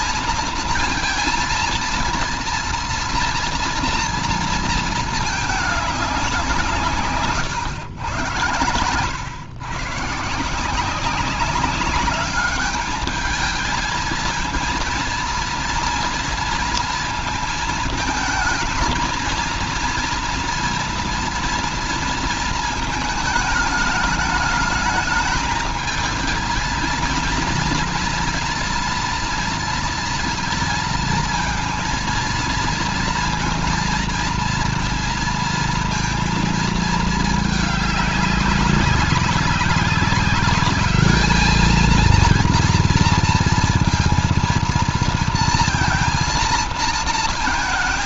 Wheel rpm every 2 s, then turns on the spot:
230, 230, 230, 180, 110, 160, 200, 230, 230, 220, 240, 230, 210, 220, 230, 230, 230, 230, 230, 190, 200, 230, 230, 230.
none